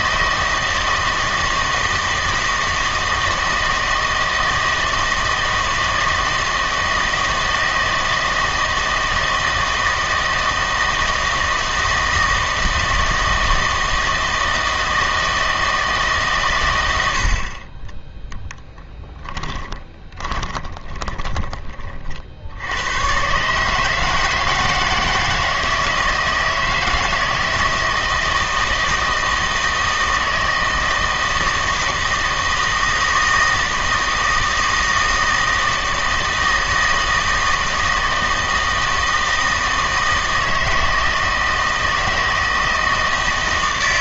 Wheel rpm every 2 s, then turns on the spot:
160, 160, 160, 160, 160, 160, 160, 160, 100, 10, 20, 100, 160, 160, 160, 160, 160, 160, 160, 160, 160, 160.
18-22